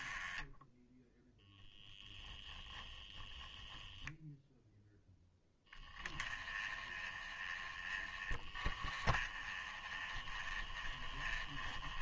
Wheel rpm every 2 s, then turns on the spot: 0, 0, 10, 20, 20, 20.
none